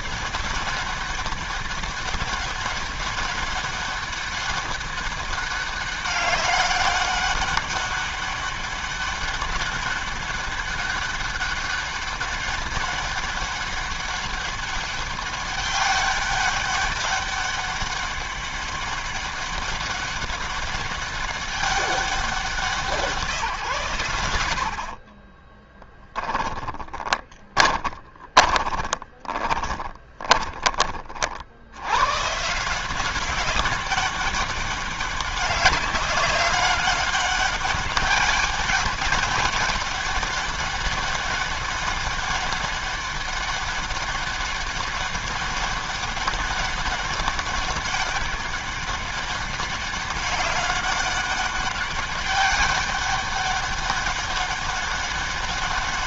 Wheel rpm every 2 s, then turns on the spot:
200, 190, 200, 200, 200, 200, 200, 200, 200, 200, 200, 180, 50, 20, 20, 30, 170, 200, 200, 200, 200, 200, 200, 200, 200, 200, 200, 200.
24-30